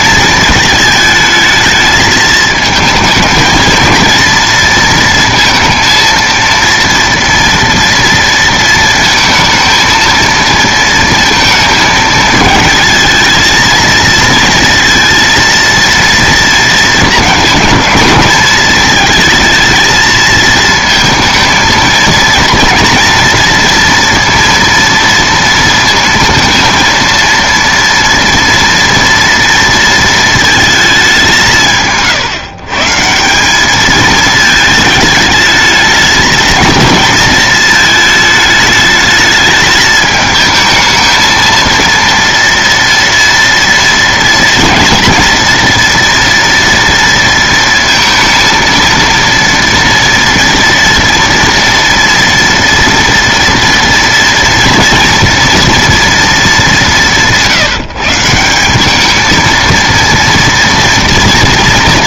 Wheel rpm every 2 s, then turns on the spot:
220, 220, 230, 230, 230, 230, 220, 230, 230, 220, 220, 230, 230, 230, 230, 220, 140, 220, 220, 210, 220, 230, 230, 240, 230, 230, 230, 230, 200, 180, 230.
none